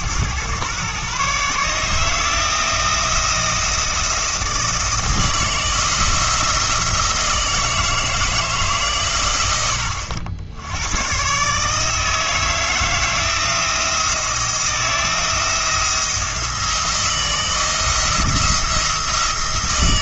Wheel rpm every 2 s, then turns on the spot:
120, 170, 160, 160, 140, 100, 160, 170, 160, 170.
none